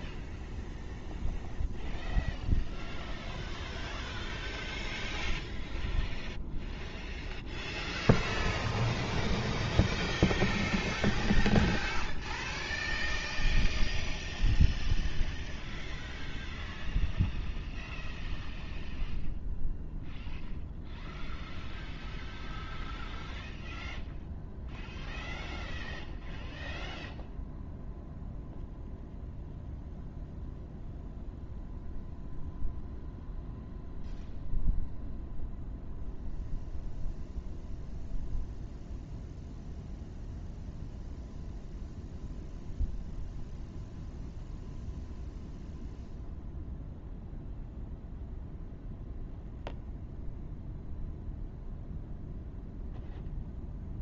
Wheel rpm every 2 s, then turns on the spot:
0, 0, 0, 0, 0, 0, 0, 0, 0, 0, 0, 0, 0, 0, 0, 0, 0, 0, 0, 0, 0, 0, 0, 0, 0, 0, 0.
none